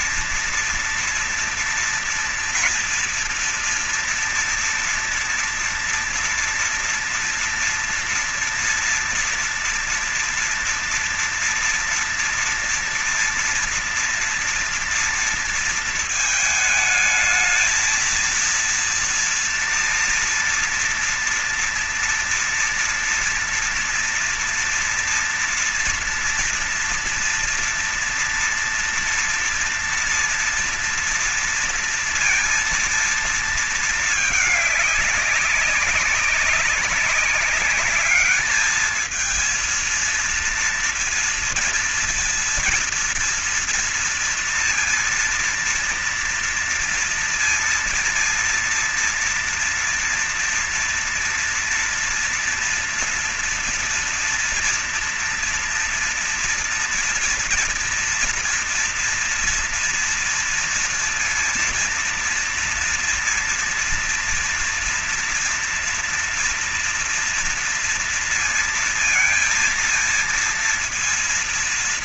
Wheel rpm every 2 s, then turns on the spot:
240, 230, 230, 240, 240, 230, 230, 230, 220, 230, 240, 230, 230, 230, 230, 230, 230, 210, 190, 210, 230, 230, 230, 230, 230, 240, 230, 230, 230, 240, 230, 230, 230, 230, 230, 230.
none